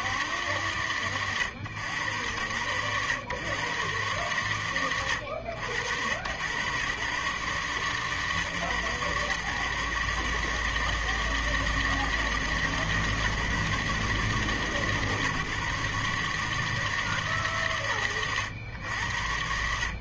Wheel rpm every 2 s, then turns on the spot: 50, 80, 110, 100, 140, 150, 160, 150, 150, 100.
none